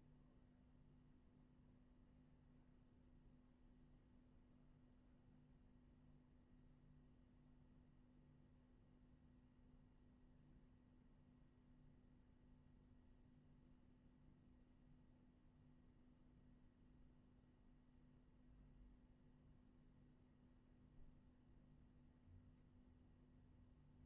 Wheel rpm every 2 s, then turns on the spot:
0, 0, 0, 0, 0, 0, 0, 0, 0, 0, 0, 0.
none